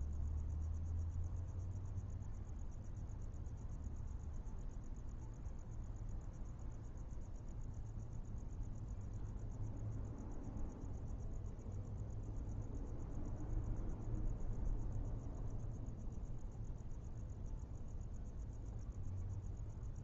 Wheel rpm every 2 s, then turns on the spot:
0, 0, 0, 0, 0, 0, 0, 0, 0, 0.
none